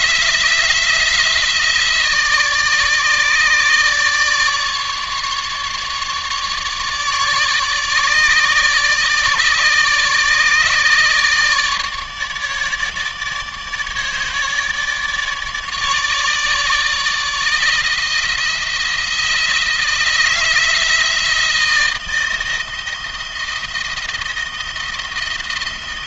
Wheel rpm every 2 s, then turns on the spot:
160, 150, 150, 150, 150, 150, 150, 150, 150, 170, 160, 160, 160.
none